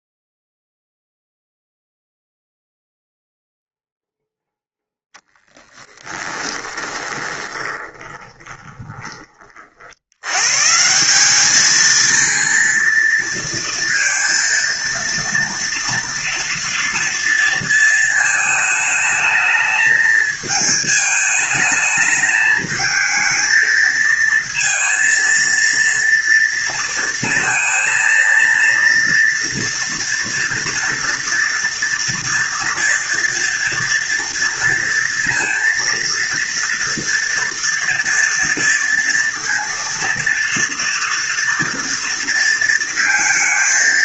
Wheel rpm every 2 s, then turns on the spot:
0, 0, 0, 20, 20, 170, 230, 230, 230, 220, 220, 220, 230, 230, 230, 230, 230, 230, 230, 230, 230, 230.
6-8